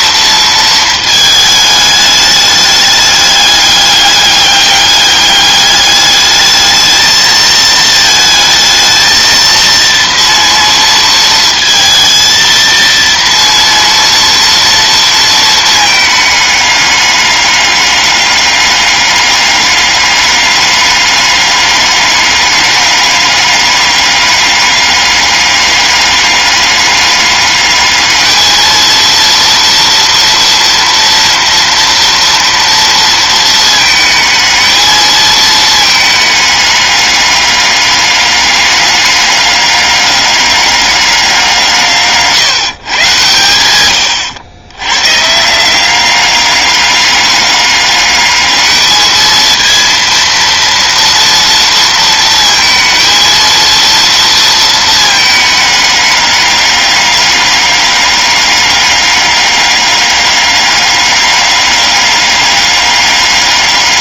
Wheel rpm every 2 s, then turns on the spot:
230, 210, 200, 220, 220, 230, 230, 230, 210, 200, 200, 200, 200, 200, 220, 230, 230, 220, 210, 200, 200, 140, 100, 200, 210, 230, 230, 230, 200, 200, 200, 200.
none